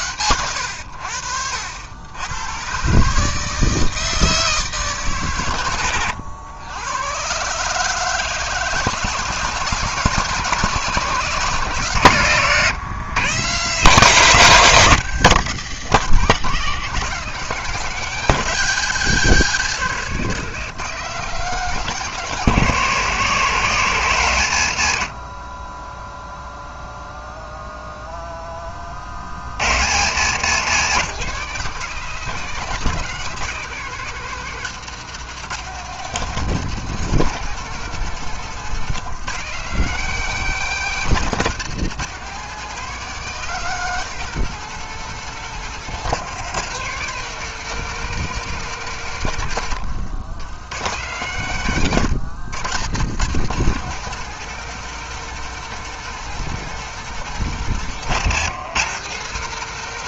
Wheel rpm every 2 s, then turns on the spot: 100, 130, 140, 110, 150, 160, 130, 180, 180, 150, 160, 140, 60, 0, 30, 160, 160, 150, 170, 160, 160, 170, 180, 180, 150, 90, 120, 180, 180, 160.
none